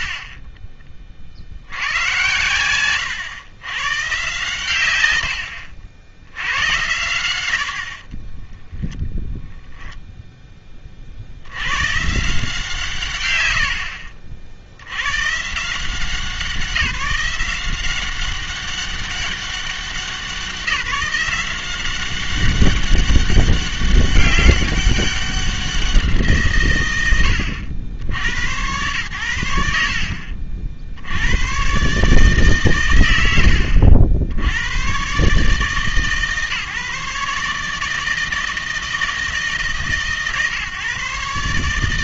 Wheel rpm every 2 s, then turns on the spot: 40, 120, 130, 100, 10, 20, 160, 70, 180, 190, 190, 200, 200, 130, 90, 60, 130, 90, 150, 160, 140.
0-2